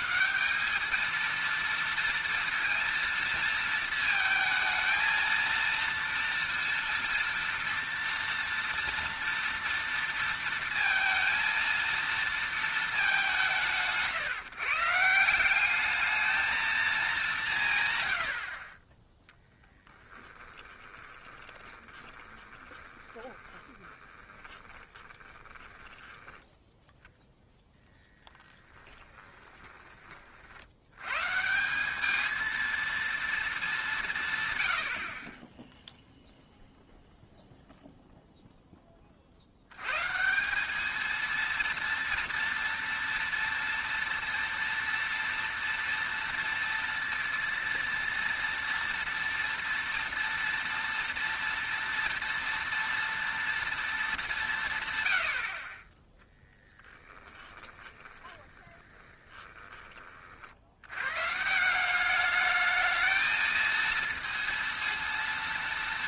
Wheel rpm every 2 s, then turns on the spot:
190, 230, 220, 230, 230, 230, 230, 140, 220, 50, 20, 20, 20, 10, 10, 80, 220, 110, 0, 0, 190, 230, 230, 230, 230, 230, 230, 160, 20, 20, 80, 210, 230.
18-26 28-30 56-60